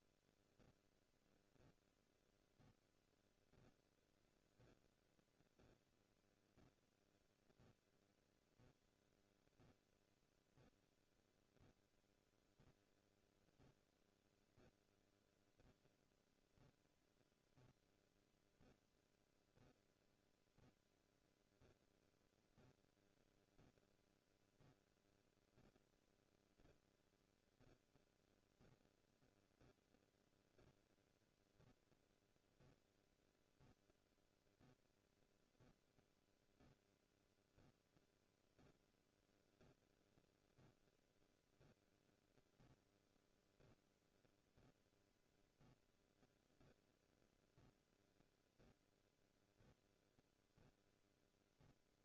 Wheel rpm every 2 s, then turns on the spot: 0, 0, 0, 0, 0, 0, 0, 0, 0, 0, 0, 0, 0, 0, 0, 0, 0, 0, 0, 0, 0, 0, 0, 0, 0, 0.
none